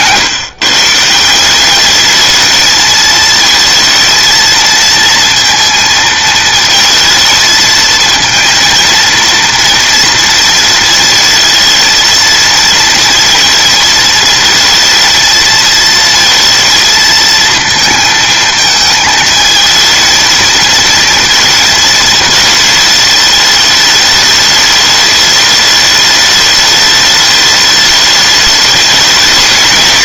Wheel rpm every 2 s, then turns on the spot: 120, 200, 230, 230, 220, 230, 220, 230, 230, 230, 220, 220, 210, 210, 210.
0-2